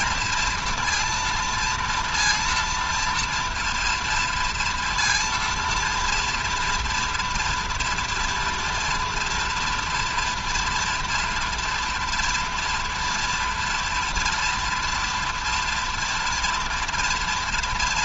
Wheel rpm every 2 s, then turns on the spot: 230, 230, 230, 230, 230, 230, 230, 230, 240.
none